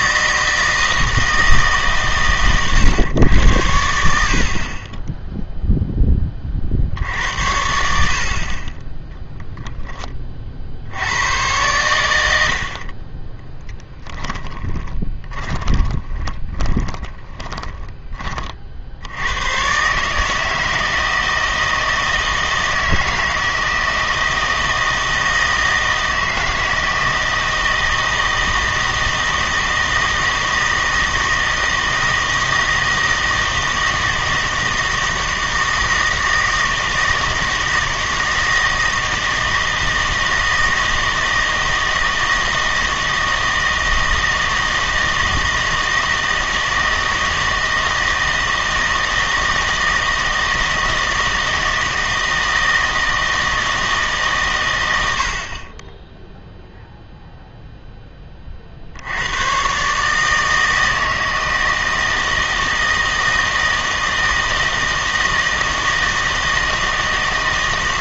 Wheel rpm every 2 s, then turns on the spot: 160, 120, 30, 50, 30, 50, 50, 10, 10, 50, 160, 160, 160, 160, 160, 160, 160, 160, 160, 160, 160, 160, 160, 160, 160, 160, 160, 110, 0, 50, 160, 160, 160, 160.
14-18